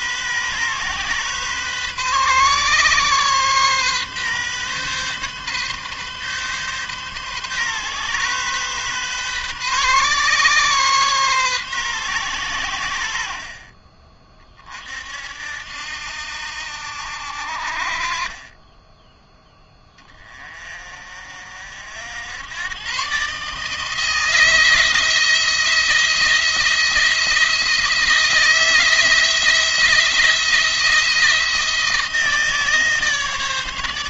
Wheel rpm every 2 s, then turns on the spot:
130, 130, 130, 130, 130, 130, 100, 40, 70, 20, 30, 110, 160, 170, 160, 170, 160.
none